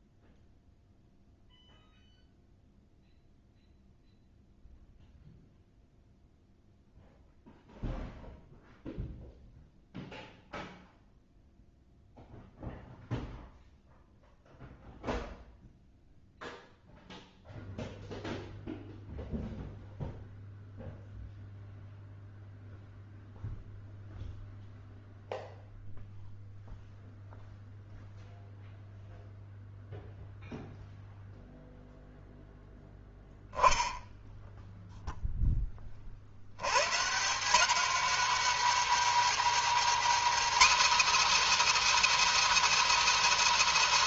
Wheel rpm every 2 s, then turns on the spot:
0, 0, 0, 0, 0, 0, 0, 0, 0, 0, 0, 0, 0, 0, 0, 0, 0, 0, 80, 230, 290, 340.
none